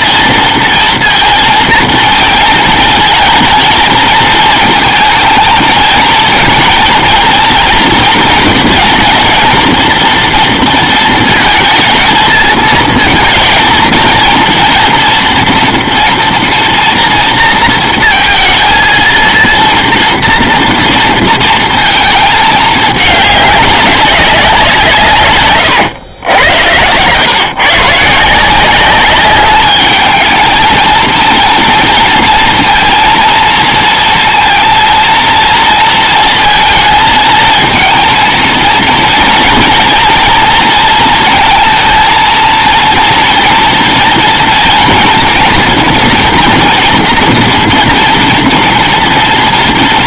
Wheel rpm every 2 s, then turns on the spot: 230, 230, 230, 230, 230, 230, 220, 230, 230, 230, 230, 220, 190, 110, 170, 220, 230, 230, 230, 230, 230, 230, 230, 230, 230.
26-28